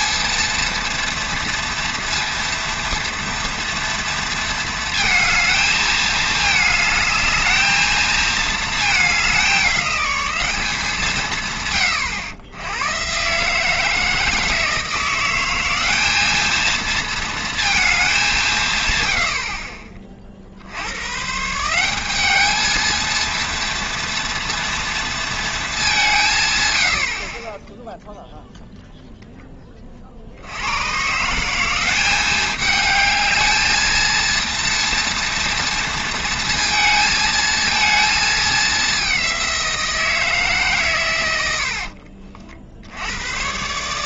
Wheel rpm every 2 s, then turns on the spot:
230, 230, 230, 210, 220, 190, 100, 160, 220, 180, 60, 210, 240, 140, 0, 80, 210, 230, 230, 210, 150, 60.
none